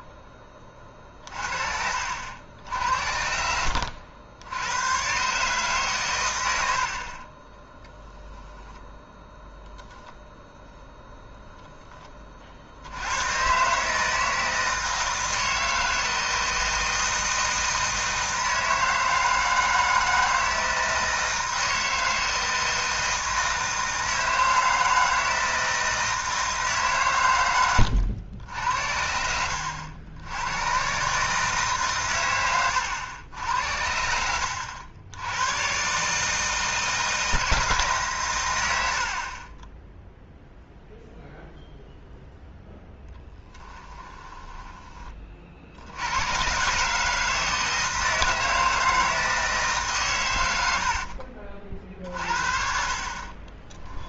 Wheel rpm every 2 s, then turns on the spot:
30, 70, 100, 80, 0, 0, 60, 160, 160, 160, 160, 160, 160, 150, 70, 120, 100, 80, 160, 100, 0, 0, 10, 130, 160, 90, 50.
6-8 32-34 50-52